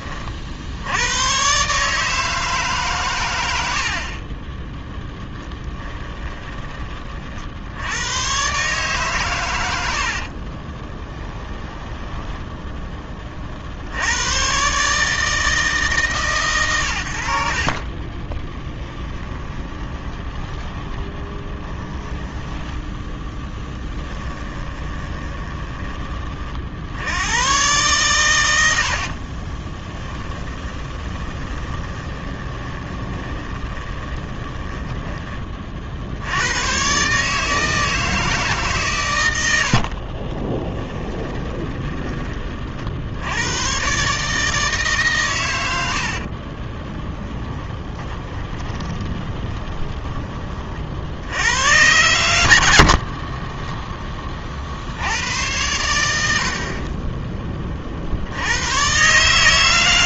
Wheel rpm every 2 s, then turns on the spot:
80, 140, 20, 30, 140, 20, 20, 140, 100, 20, 20, 10, 20, 60, 70, 20, 20, 20, 120, 140, 10, 60, 150, 20, 20, 50, 70, 50, 40, 110.
4-6 10-12 18-22 24-26 28-36 40-42 46-50 52-54 56-58